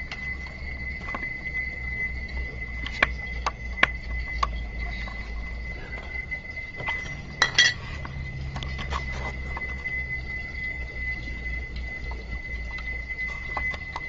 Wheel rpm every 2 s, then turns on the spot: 0, 0, 0, 0, 0, 0, 0.
none